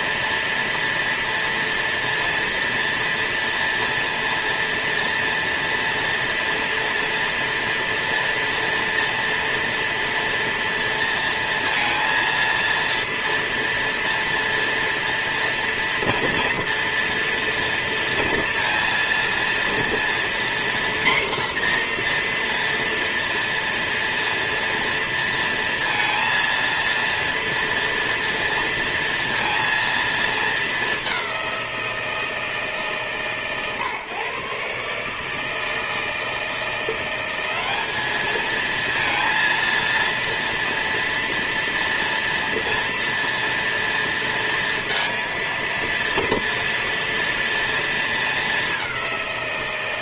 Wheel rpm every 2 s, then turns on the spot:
230, 230, 230, 230, 230, 230, 230, 230, 230, 230, 240, 230, 230, 230, 230, 200, 140, 150, 170, 230, 230, 230, 230, 230, 200.
none